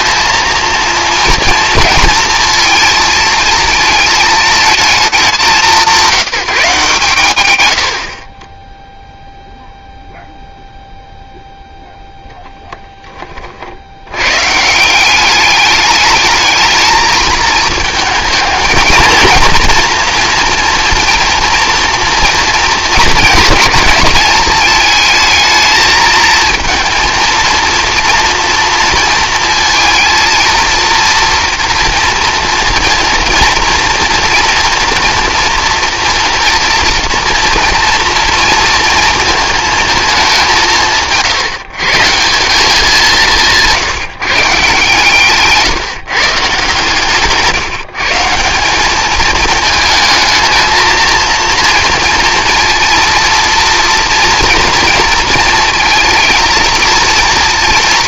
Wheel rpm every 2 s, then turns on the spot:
230, 230, 220, 150, 10, 0, 10, 170, 220, 230, 230, 220, 220, 230, 230, 230, 230, 230, 240, 230, 150, 180, 140, 140, 210, 230, 230, 230, 230.
46-48